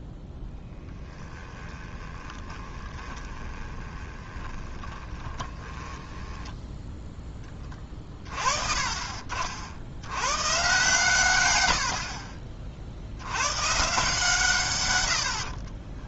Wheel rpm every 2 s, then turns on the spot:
10, 20, 20, 10, 40, 130, 40, 130.
0-8